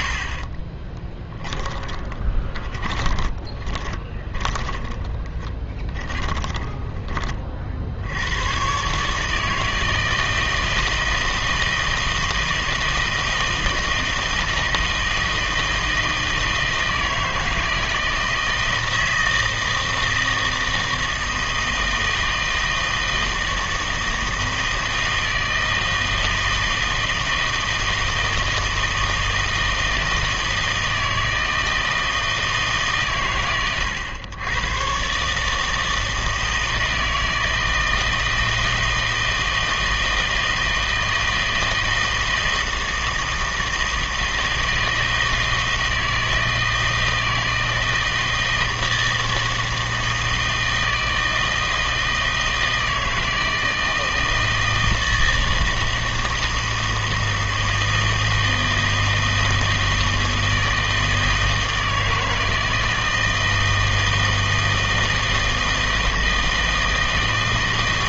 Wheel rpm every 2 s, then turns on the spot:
30, 20, 20, 20, 120, 160, 160, 160, 160, 160, 160, 160, 160, 160, 160, 160, 120, 110, 160, 160, 160, 160, 160, 160, 160, 160, 160, 160, 160, 160, 160, 160, 160, 160.
0-8